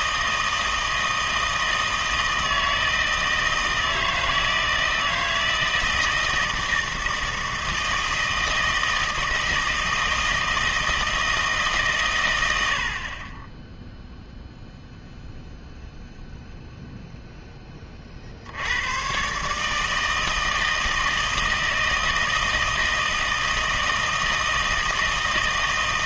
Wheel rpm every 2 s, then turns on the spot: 160, 160, 160, 160, 160, 160, 80, 0, 0, 80, 160, 160, 160.
none